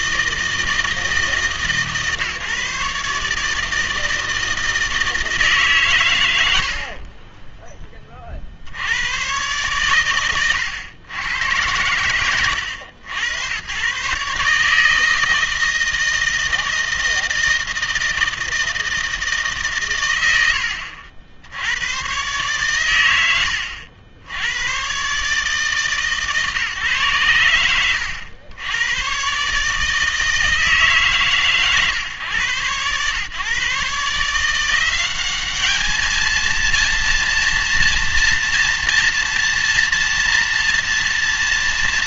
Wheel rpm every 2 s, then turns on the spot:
160, 140, 160, 50, 70, 110, 80, 150, 160, 160, 90, 120, 110, 140, 100, 160, 110, 170, 230, 230, 230.
none